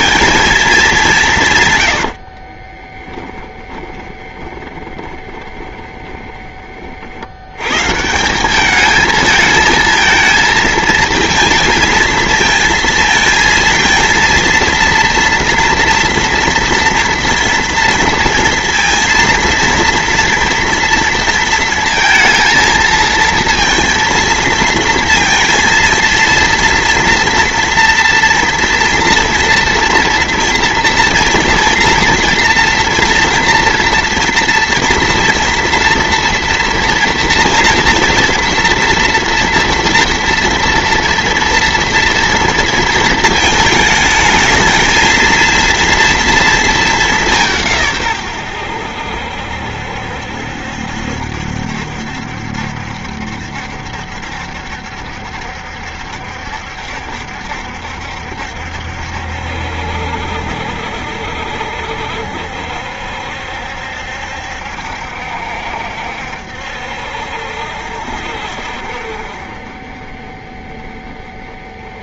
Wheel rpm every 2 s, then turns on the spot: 110, 20, 20, 100, 220, 230, 230, 230, 230, 230, 230, 230, 230, 230, 230, 230, 230, 230, 230, 230, 230, 220, 230, 180, 70, 70, 70, 70, 70, 70, 70, 70, 70, 70, 50, 20.
0-6